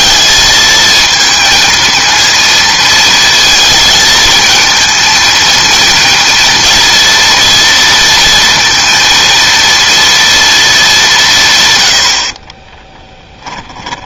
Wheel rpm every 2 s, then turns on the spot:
220, 230, 230, 230, 230, 190, 10.
12-14